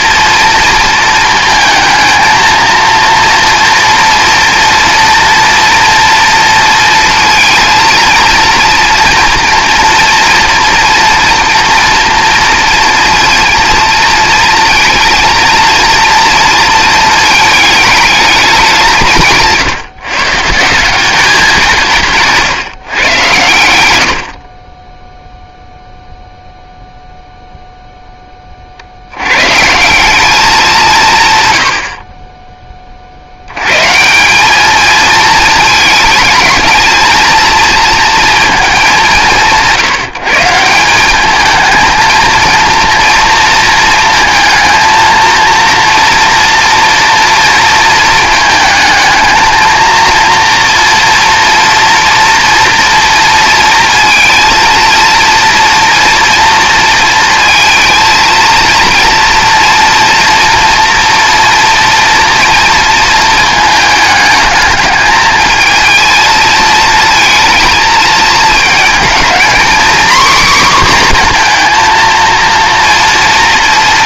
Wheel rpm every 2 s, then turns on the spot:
230, 230, 230, 230, 230, 230, 230, 230, 230, 190, 160, 140, 20, 0, 50, 190, 20, 210, 220, 220, 170, 230, 220, 240, 220, 230, 240, 230, 230, 230, 230, 230, 210, 220, 220, 250, 230.
none